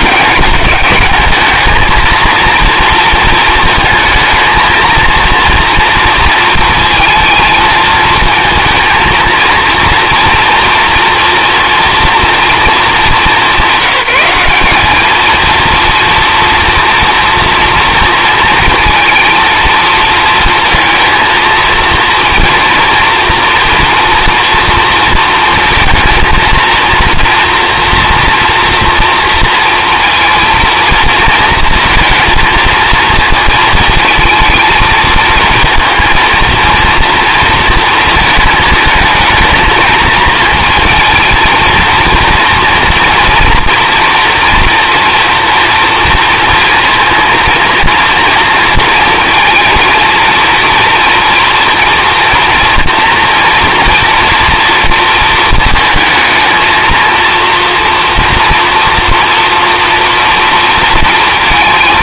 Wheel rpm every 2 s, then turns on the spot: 210, 230, 220, 220, 220, 230, 220, 200, 230, 220, 230, 230, 230, 230, 230, 230, 230, 220, 230, 220, 220, 230, 240, 230, 230, 230, 230, 230, 220, 230, 230.
none